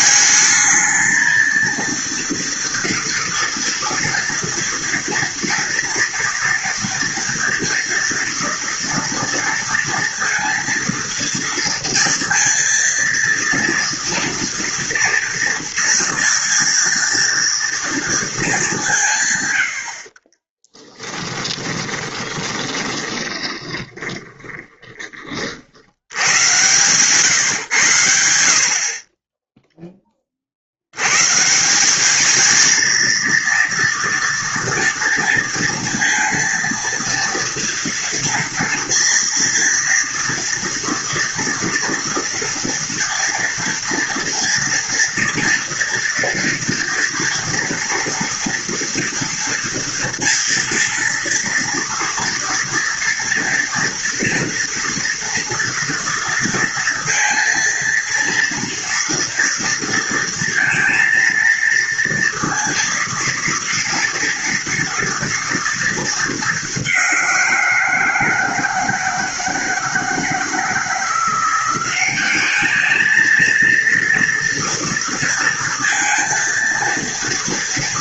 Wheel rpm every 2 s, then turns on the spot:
220, 230, 230, 240, 230, 230, 230, 230, 230, 200, 40, 20, 20, 110, 60, 70, 220, 230, 230, 230, 230, 230, 230, 240, 230, 230, 230, 230, 230, 230, 230, 230, 230, 210, 160, 160, 210, 230, 230.
20-28